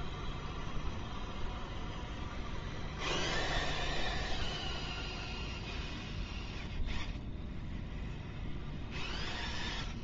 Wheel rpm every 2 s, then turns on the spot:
0, 0, 0, 0, 0.
none